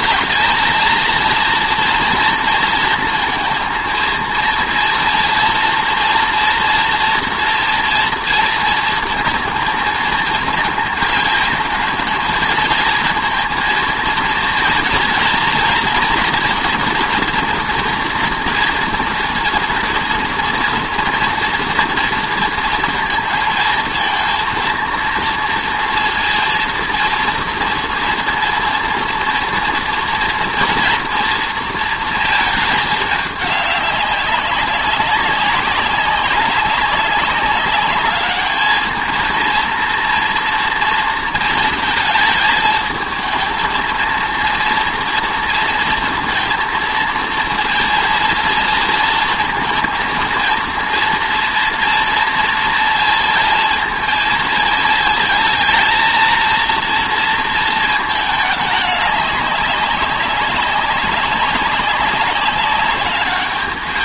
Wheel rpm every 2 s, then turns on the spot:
220, 230, 230, 240, 220, 220, 230, 230, 240, 230, 230, 230, 230, 230, 230, 230, 220, 200, 190, 210, 230, 220, 230, 230, 240, 230, 230, 230, 230, 210, 200, 200.
none